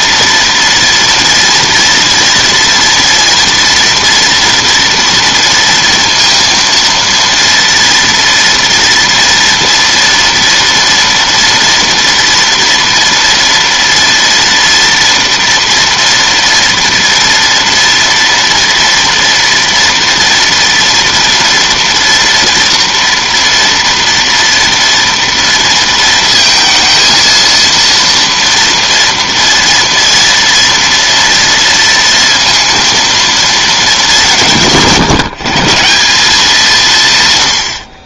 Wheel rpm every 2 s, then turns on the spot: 230, 230, 230, 230, 230, 230, 230, 230, 230, 230, 230, 230, 230, 230, 230, 230, 230, 140, 160.
none